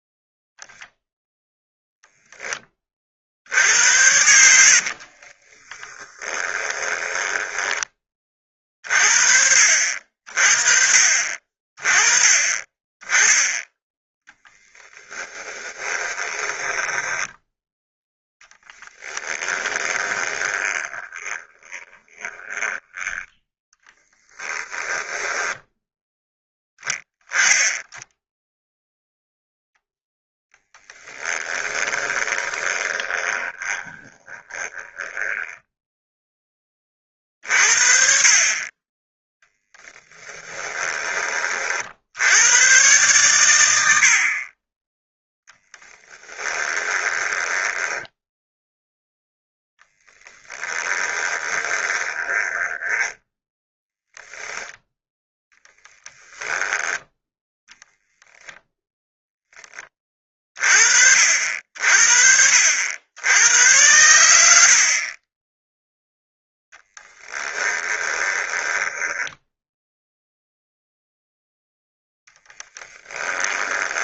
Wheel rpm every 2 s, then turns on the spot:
0, 30, 60, 20, 40, 40, 20, 10, 10, 10, 20, 20, 10, 10, 0, 10, 20, 10, 20, 20, 20, 120, 20, 10, 0, 10, 10, 10, 10, 10, 40, 80, 50, 10, 10, 0, 10.
4-8 14-22 24-26 30-36 40-42 46-48 50-54 64-70 72-74